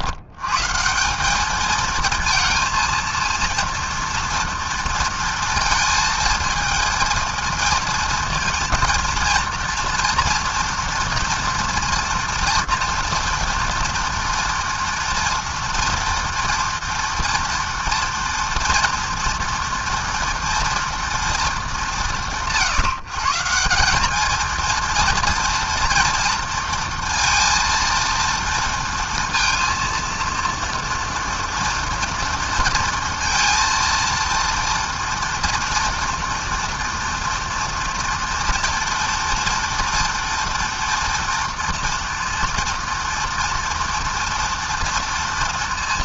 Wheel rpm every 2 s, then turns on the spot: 130, 230, 230, 230, 230, 230, 230, 230, 230, 240, 230, 170, 230, 230, 230, 230, 230, 230, 230, 230, 230, 230, 230.
none